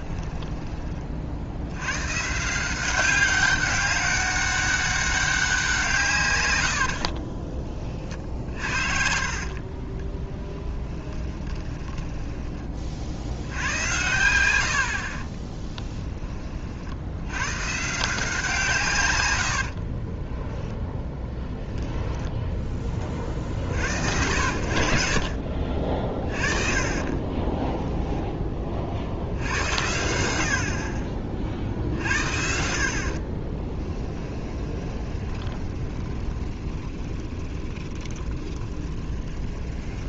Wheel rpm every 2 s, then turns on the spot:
20, 180, 200, 100, 50, 10, 30, 70, 50, 140, 0, 20, 60, 40, 30, 60, 60, 20, 20, 20.
8-12 26-28 34-40